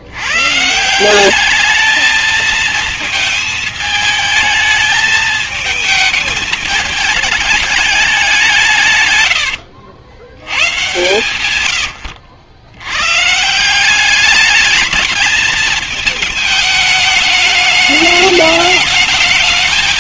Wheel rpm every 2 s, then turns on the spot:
110, 220, 210, 210, 190, 90, 90, 200, 220, 210.
none